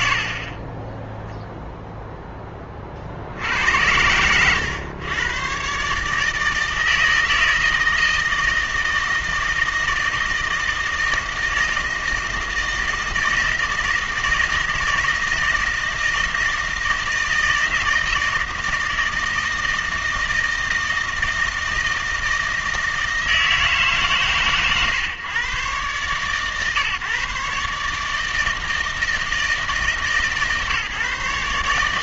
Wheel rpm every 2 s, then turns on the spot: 40, 0, 110, 160, 160, 160, 160, 160, 160, 160, 160, 160, 130, 140, 160, 140.
none